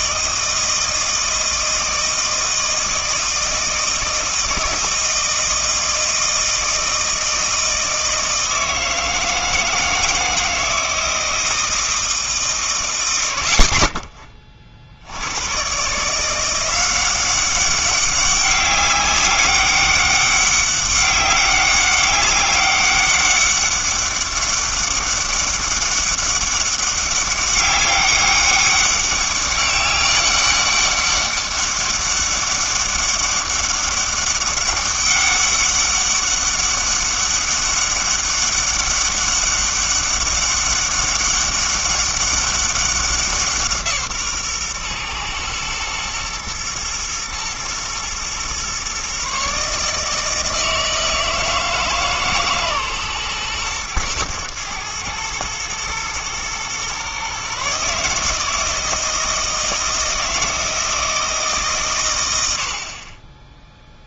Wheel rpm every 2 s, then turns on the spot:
160, 160, 160, 160, 160, 160, 140, 40, 180, 200, 200, 200, 200, 200, 200, 200, 200, 200, 200, 200, 200, 190, 130, 110, 130, 160, 140, 110, 120, 160, 160, 70.
none